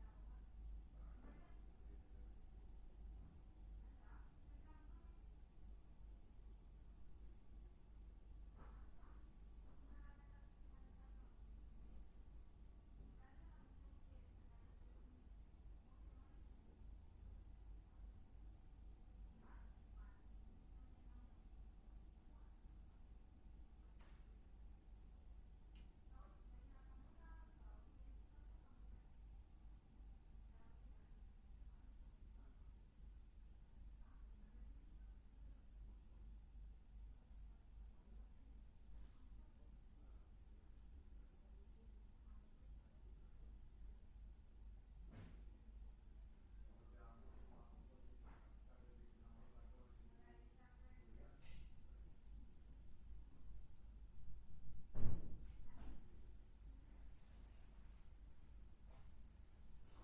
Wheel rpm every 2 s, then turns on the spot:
0, 0, 0, 0, 0, 0, 0, 0, 0, 0, 0, 0, 0, 0, 0, 0, 0, 0, 0, 0, 0, 0, 0, 0, 0, 0, 0, 0, 0, 0.
none